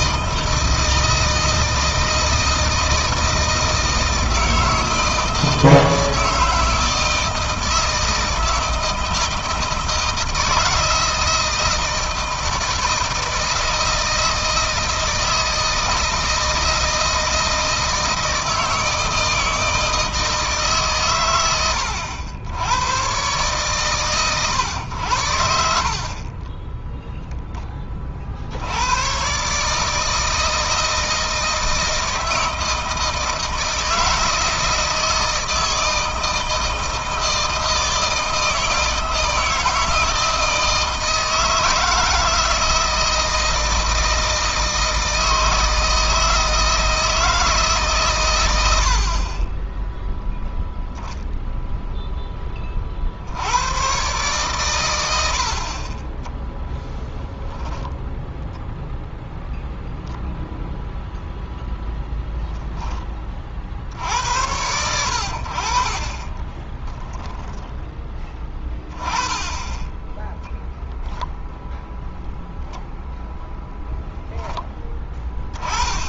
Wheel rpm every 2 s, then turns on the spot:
160, 160, 160, 160, 160, 160, 160, 160, 160, 160, 140, 120, 100, 10, 80, 160, 160, 160, 160, 160, 160, 160, 160, 160, 80, 0, 30, 100, 0, 0, 0, 10, 80, 10, 10, 0, 0, 10.
26-28 66-68